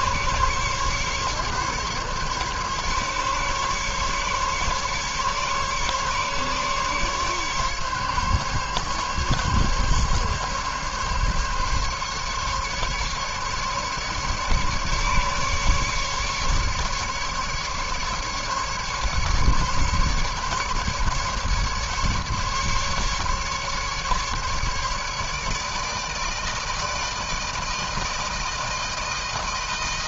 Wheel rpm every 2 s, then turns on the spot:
140, 140, 140, 140, 140, 140, 140, 140, 140, 150, 140, 150, 150, 160, 160.
none